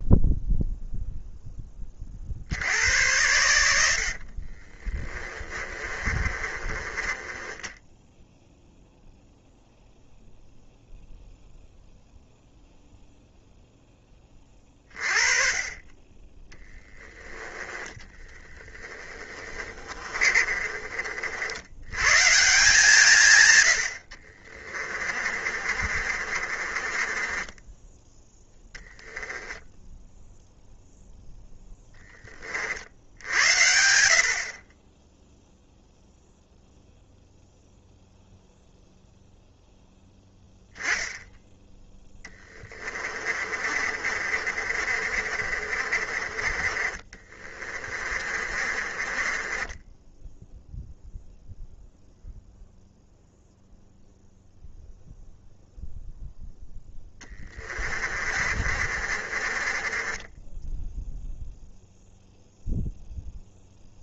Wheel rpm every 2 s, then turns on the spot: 0, 90, 30, 20, 0, 0, 0, 30, 10, 20, 40, 150, 30, 30, 0, 0, 70, 20, 0, 0, 0, 30, 50, 30, 30, 0, 0, 0, 10, 40, 0, 0.
4-8 18-20 24-28 42-50 56-60